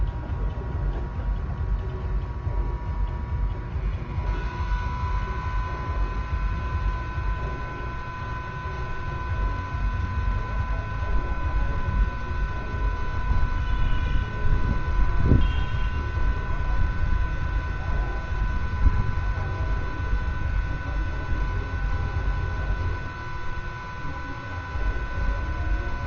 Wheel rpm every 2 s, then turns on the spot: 0, 0, 0, 0, 0, 0, 0, 0, 0, 0, 0, 0, 0.
none